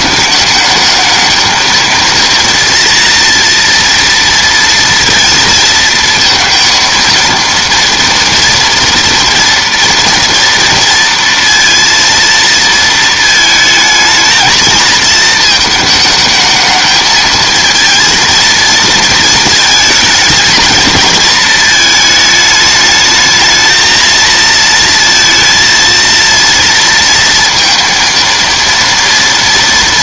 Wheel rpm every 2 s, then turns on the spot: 210, 230, 230, 230, 240, 230, 230, 220, 220, 230, 220, 210, 230, 230, 230.
none